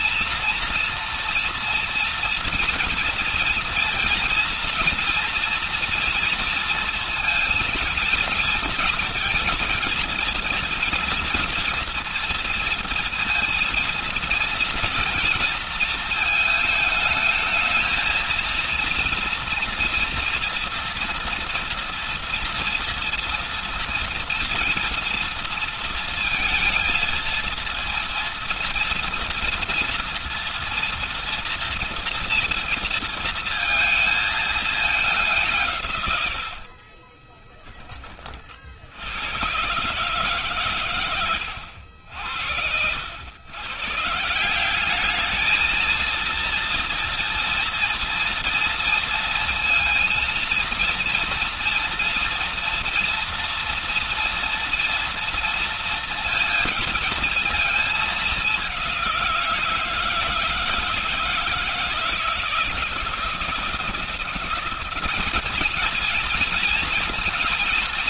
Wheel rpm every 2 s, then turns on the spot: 230, 230, 240, 230, 230, 230, 230, 240, 220, 230, 230, 230, 230, 230, 230, 230, 230, 220, 70, 50, 130, 70, 180, 230, 230, 230, 230, 230, 230, 200, 170, 160, 170, 230.
36-38